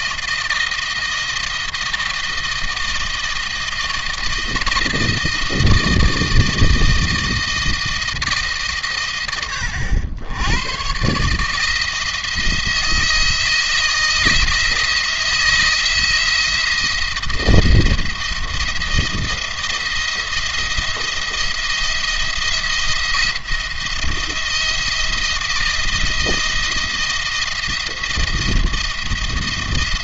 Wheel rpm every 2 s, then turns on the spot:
160, 160, 160, 160, 140, 110, 160, 160, 170, 170, 170, 170, 170, 160, 170.
none